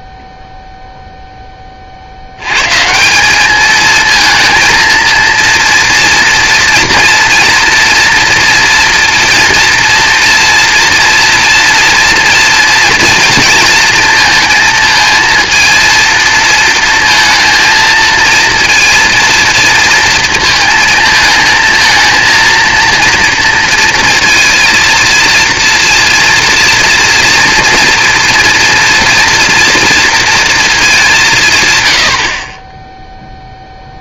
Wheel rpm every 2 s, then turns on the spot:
0, 110, 230, 230, 230, 230, 230, 220, 230, 230, 230, 230, 230, 230, 230, 220, 70.
none